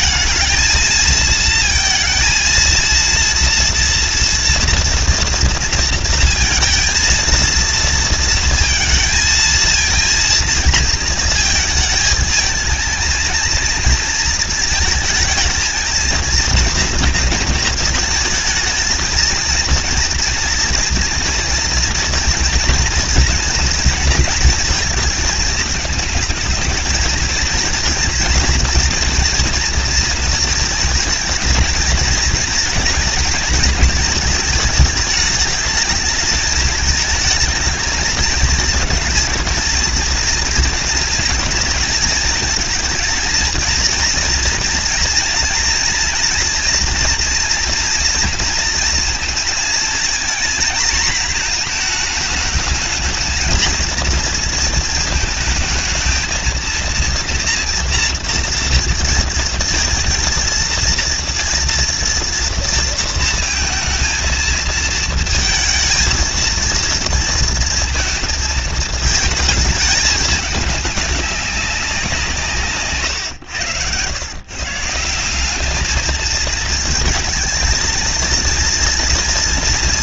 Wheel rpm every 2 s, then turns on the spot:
220, 230, 230, 230, 230, 230, 220, 230, 230, 220, 230, 230, 230, 210, 230, 220, 230, 220, 220, 220, 220, 220, 230, 230, 230, 230, 220, 230, 220, 230, 230, 230, 220, 230, 220, 210, 170, 130, 220, 230.
none